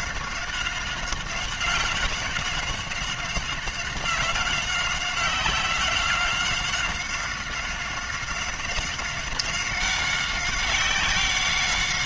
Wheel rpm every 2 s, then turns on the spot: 190, 190, 190, 190, 190, 190.
none